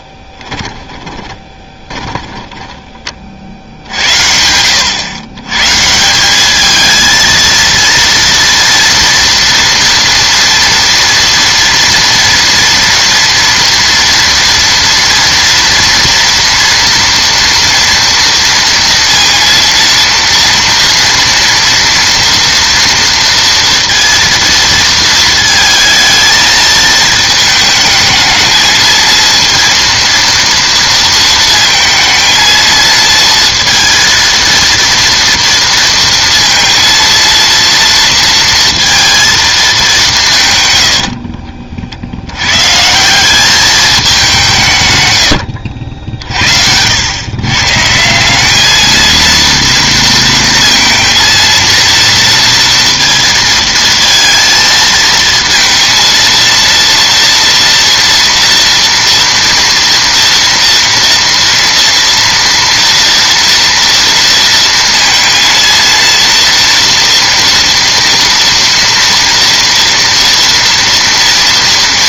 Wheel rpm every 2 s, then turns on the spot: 10, 10, 90, 220, 230, 230, 230, 240, 240, 230, 230, 230, 230, 220, 220, 230, 220, 230, 230, 230, 100, 140, 150, 80, 210, 230, 230, 230, 230, 230, 230, 230, 230, 230, 230, 230.
0-4 40-42